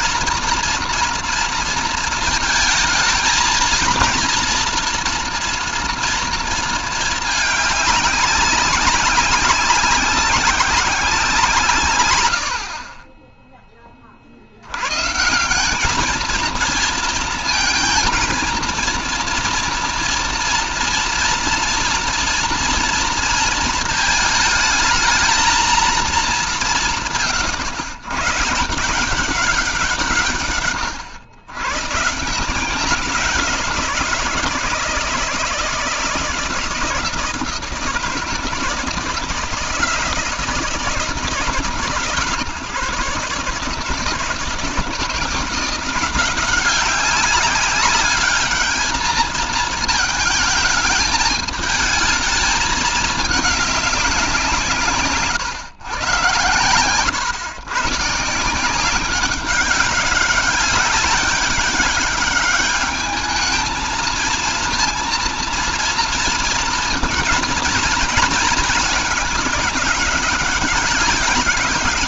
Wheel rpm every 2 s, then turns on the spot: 230, 220, 230, 220, 200, 180, 40, 120, 230, 230, 230, 230, 220, 170, 160, 120, 180, 160, 160, 160, 150, 140, 170, 190, 220, 220, 220, 160, 120, 180, 200, 210, 230, 230, 210, 200.
none